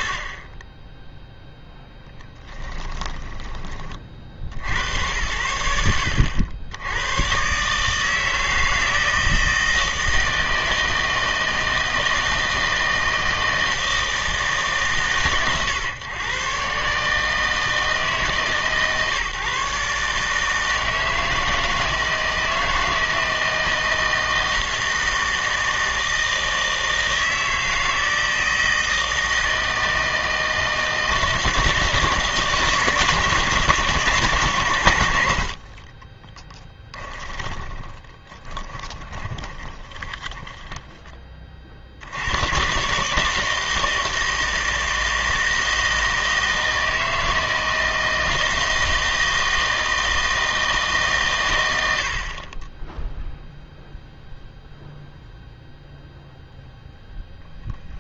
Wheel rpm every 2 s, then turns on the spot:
10, 10, 80, 80, 160, 160, 160, 130, 140, 140, 160, 160, 160, 160, 160, 160, 160, 130, 10, 20, 10, 130, 160, 160, 160, 150, 20, 0, 0.
2-4 36-40